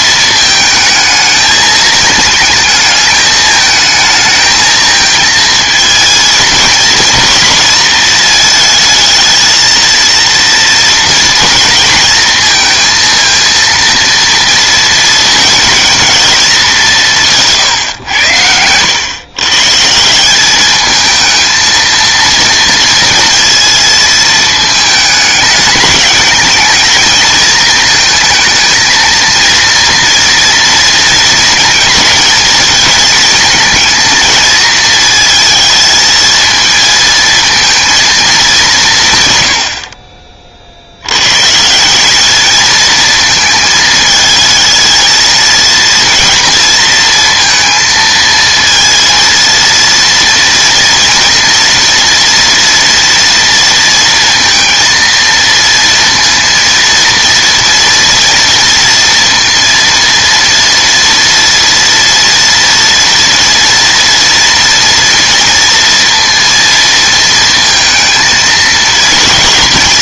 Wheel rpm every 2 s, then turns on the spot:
220, 220, 220, 220, 220, 230, 230, 230, 200, 100, 210, 230, 220, 220, 220, 230, 220, 220, 220, 170, 60, 220, 220, 230, 230, 230, 240, 230, 230, 230, 230, 230, 230, 230, 220.
none